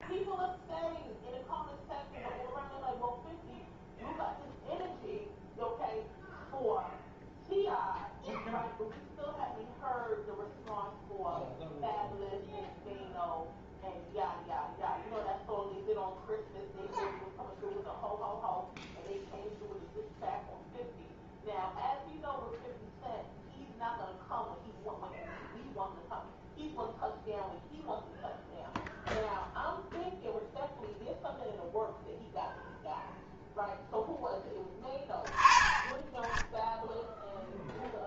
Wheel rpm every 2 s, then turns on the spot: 0, 0, 0, 0, 0, 0, 0, 0, 0, 0, 0, 0, 0, 0, 0, 0, 0, 10, 10.
none